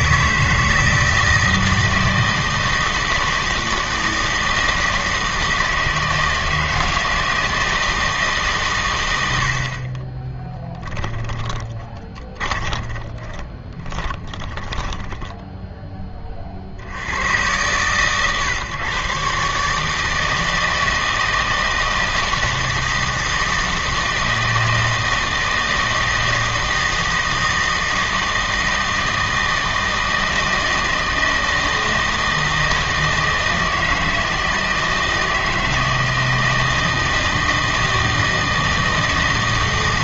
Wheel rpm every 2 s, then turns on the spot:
160, 160, 160, 160, 130, 10, 20, 20, 50, 130, 160, 160, 160, 160, 160, 160, 160, 160, 160, 160.
10-16